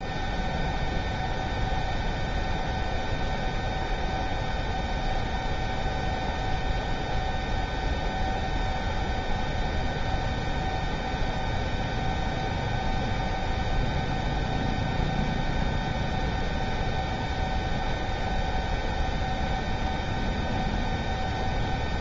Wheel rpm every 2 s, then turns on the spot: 0, 0, 0, 0, 0, 0, 0, 0, 0, 0, 0.
none